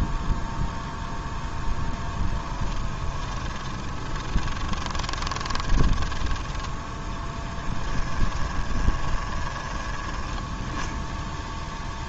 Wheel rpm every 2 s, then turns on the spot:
0, 10, 20, 10, 20, 10.
2-6 8-10